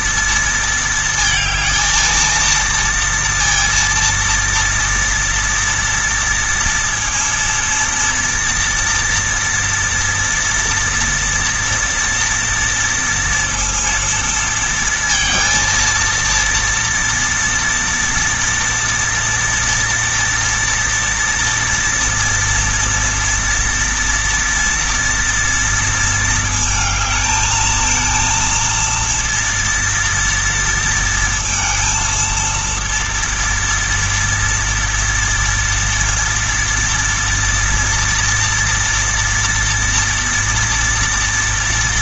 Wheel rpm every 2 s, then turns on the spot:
230, 230, 230, 230, 230, 230, 230, 230, 240, 240, 230, 230, 240, 220, 230, 230, 230, 240, 230, 240, 240.
none